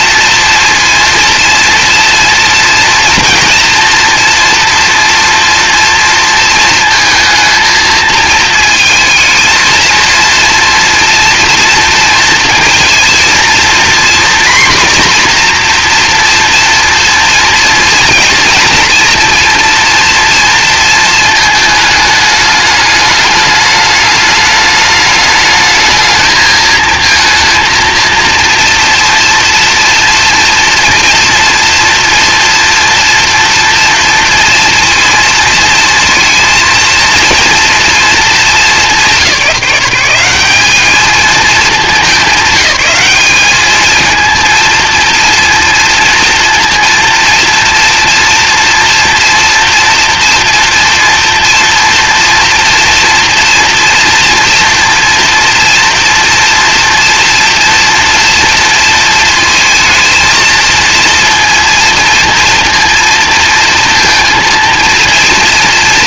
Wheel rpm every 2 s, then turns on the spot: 230, 230, 230, 220, 220, 240, 230, 250, 230, 230, 230, 210, 220, 230, 230, 230, 230, 230, 230, 210, 200, 200, 230, 230, 230, 230, 230, 240, 230, 230, 230, 230, 230.
none